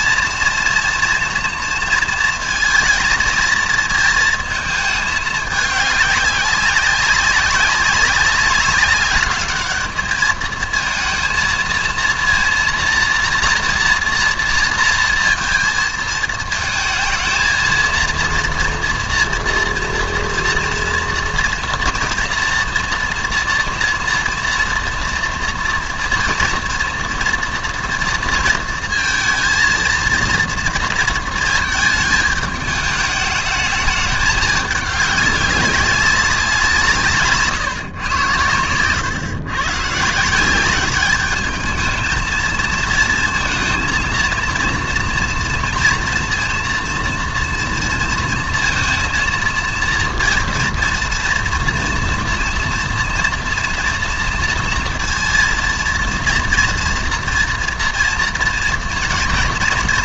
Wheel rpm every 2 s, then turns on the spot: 240, 230, 220, 200, 200, 220, 230, 230, 220, 230, 230, 230, 230, 230, 230, 230, 210, 210, 190, 110, 190, 230, 230, 230, 230, 230, 230, 230, 230, 230.
38-40